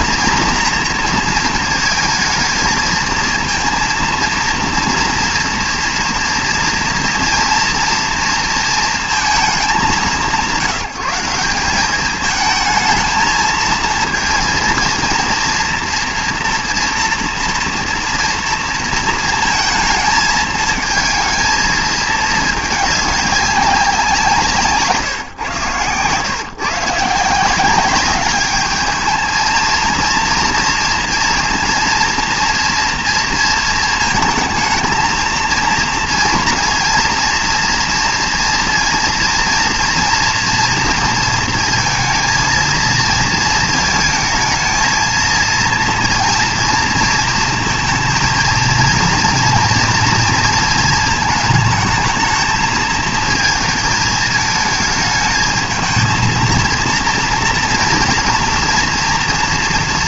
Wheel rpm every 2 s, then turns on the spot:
230, 220, 230, 230, 230, 170, 220, 230, 230, 230, 220, 210, 160, 130, 210, 230, 230, 220, 230, 230, 230, 230, 220, 230, 230, 230, 220, 220, 230, 230.
none